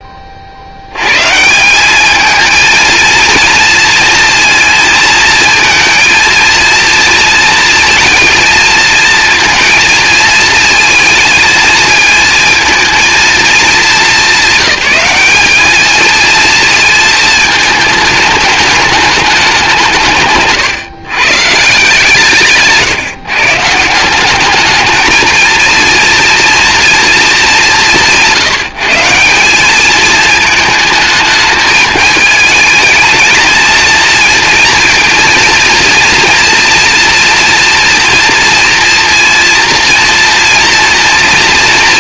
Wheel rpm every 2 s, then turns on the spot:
100, 230, 230, 230, 230, 220, 220, 200, 220, 210, 130, 150, 210, 230, 160, 220, 220, 230, 230, 230, 230.
none